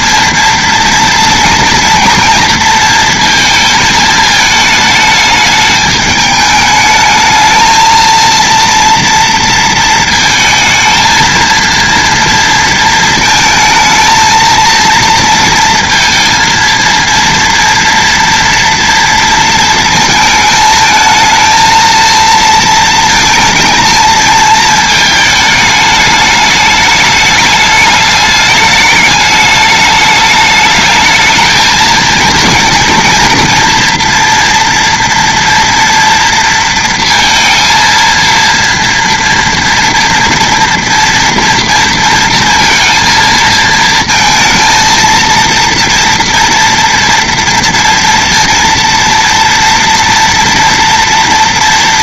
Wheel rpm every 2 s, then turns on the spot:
230, 230, 220, 220, 230, 220, 220, 230, 230, 230, 220, 220, 220, 210, 210, 220, 230, 230, 230, 230, 230, 230, 230, 240, 230, 230.
none